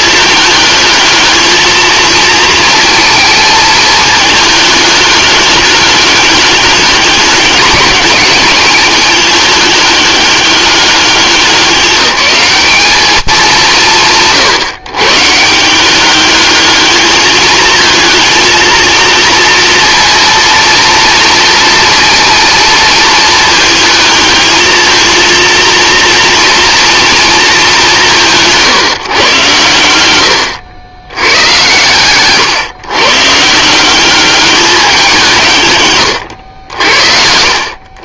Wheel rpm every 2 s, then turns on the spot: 220, 220, 210, 200, 200, 200, 210, 130, 210, 230, 240, 230, 220, 230, 140, 100, 120, 190, 80.
none